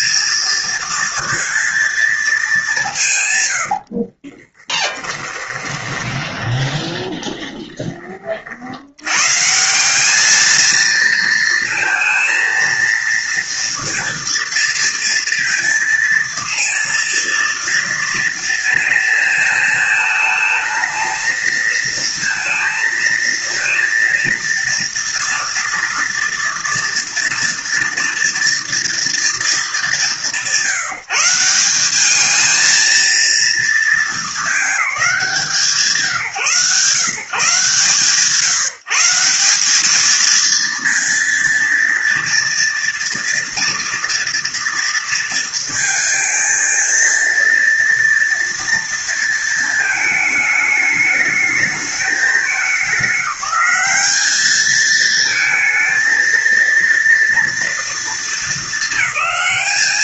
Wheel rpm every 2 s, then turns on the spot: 230, 140, 20, 20, 120, 230, 230, 230, 230, 220, 220, 230, 230, 230, 210, 170, 230, 200, 140, 180, 230, 240, 230, 230, 230, 210, 200, 220, 230, 210.
4-8